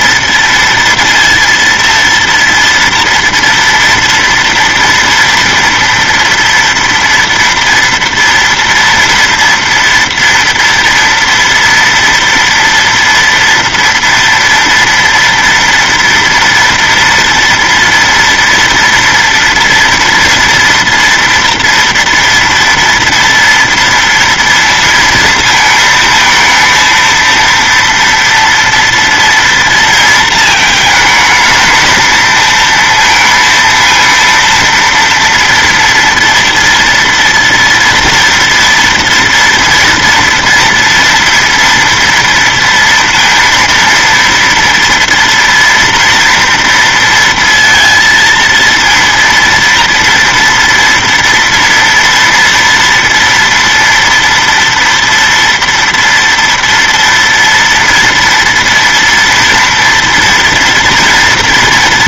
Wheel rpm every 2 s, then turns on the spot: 230, 230, 230, 230, 240, 230, 230, 230, 240, 230, 230, 230, 230, 230, 230, 220, 230, 230, 230, 230, 230, 230, 230, 230, 230, 240, 230, 230, 230, 230, 240.
none